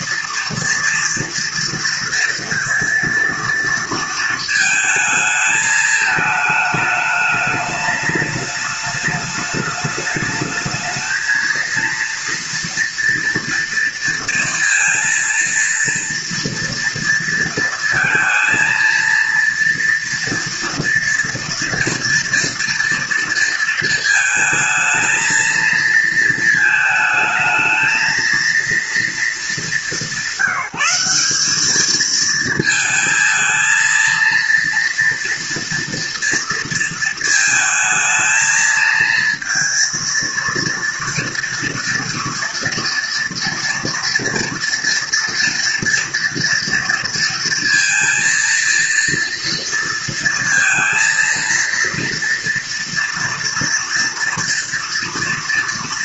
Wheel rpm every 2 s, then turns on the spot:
230, 240, 220, 210, 210, 220, 230, 230, 230, 230, 230, 230, 220, 220, 230, 180, 220, 230, 230, 230, 230, 240, 230, 230, 230, 230, 230, 230.
none